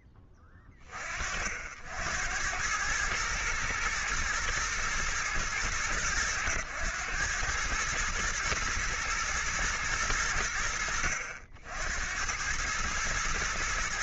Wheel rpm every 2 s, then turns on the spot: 30, 100, 110, 100, 110, 70, 110.
none